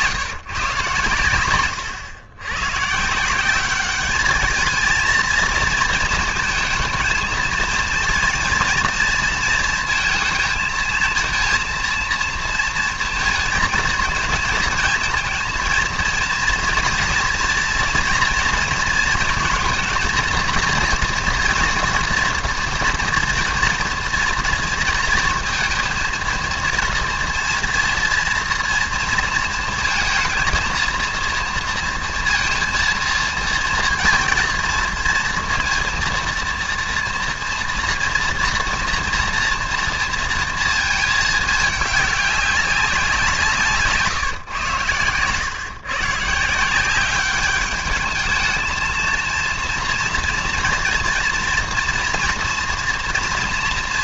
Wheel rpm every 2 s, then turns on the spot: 130, 120, 220, 230, 230, 220, 230, 220, 230, 230, 230, 230, 230, 230, 230, 230, 230, 230, 230, 230, 230, 200, 120, 160, 220, 230, 240.
none